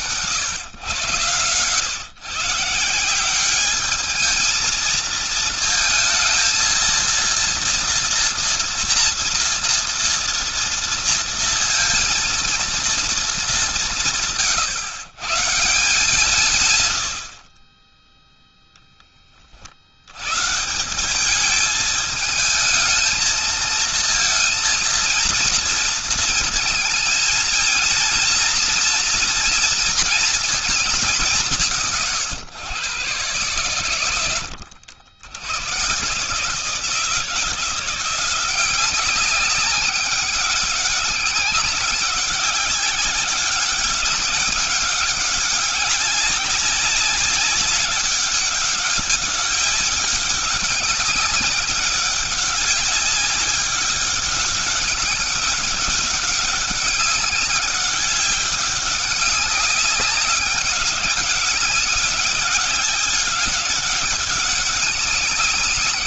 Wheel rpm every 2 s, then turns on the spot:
120, 160, 220, 230, 230, 230, 230, 150, 130, 0, 120, 220, 230, 220, 240, 220, 120, 90, 150, 180, 200, 190, 200, 200, 200, 200, 200, 200, 200, 200, 190, 190, 190.
34-36